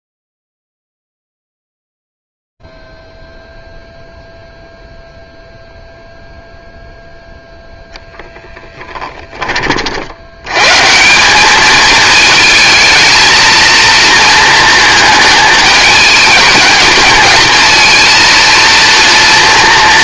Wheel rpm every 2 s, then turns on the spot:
0, 0, 0, 0, 0, 100, 220, 230, 210, 230.
none